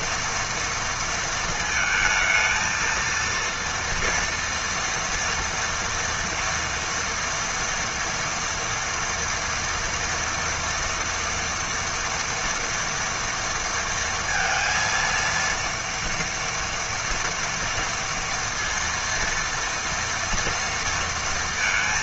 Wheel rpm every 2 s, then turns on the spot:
230, 230, 230, 230, 230, 230, 230, 230, 240, 230, 230.
none